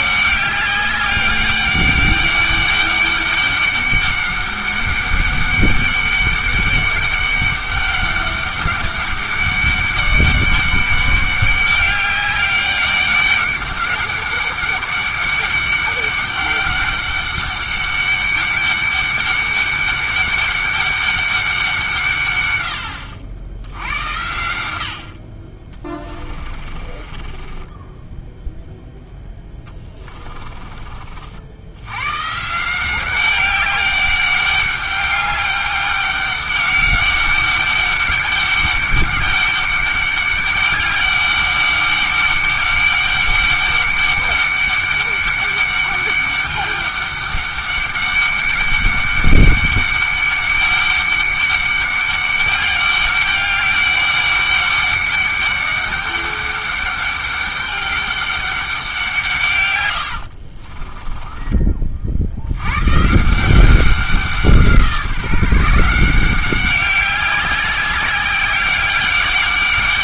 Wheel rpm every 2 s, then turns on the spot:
200, 200, 200, 200, 200, 200, 200, 200, 200, 200, 200, 90, 80, 30, 0, 30, 170, 200, 200, 200, 200, 200, 200, 200, 200, 200, 200, 200, 200, 190, 30, 130, 170, 190, 190.
26-28 60-62